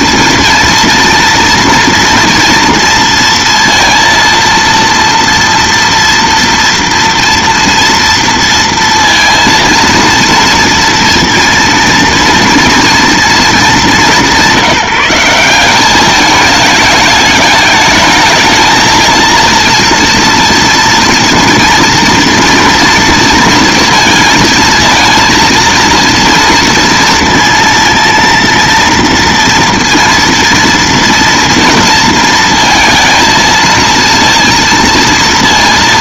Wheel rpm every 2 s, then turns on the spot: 230, 230, 230, 230, 230, 230, 230, 170, 210, 220, 230, 230, 230, 230, 230, 230, 230, 230.
none